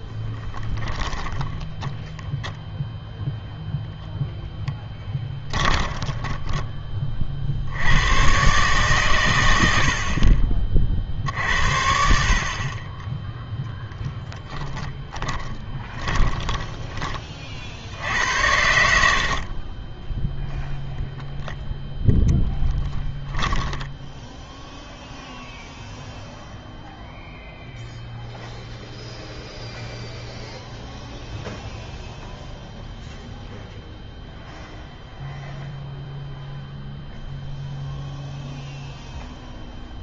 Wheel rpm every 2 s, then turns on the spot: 10, 0, 10, 20, 130, 40, 40, 10, 20, 80, 0, 10, 0, 0, 0, 0, 0, 0, 0, 0.
0-2 4-6 14-18 22-24